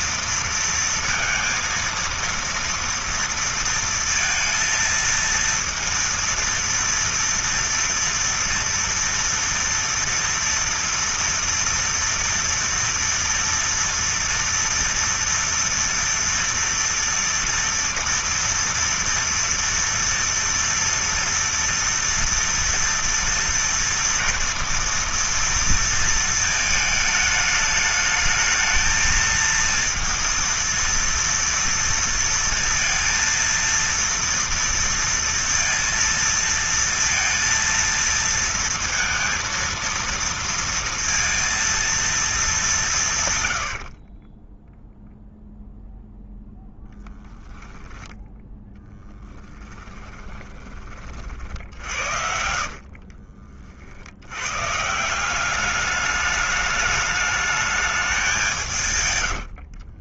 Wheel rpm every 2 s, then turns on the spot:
230, 230, 230, 230, 230, 230, 230, 230, 230, 230, 230, 230, 230, 220, 220, 230, 230, 230, 230, 230, 230, 120, 0, 10, 20, 50, 50, 190, 210, 90.
46-50 58-60